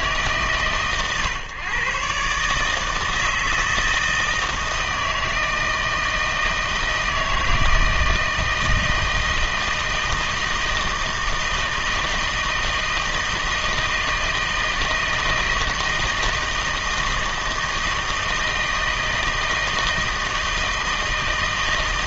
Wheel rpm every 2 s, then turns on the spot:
130, 150, 160, 160, 160, 160, 160, 160, 160, 160, 160.
none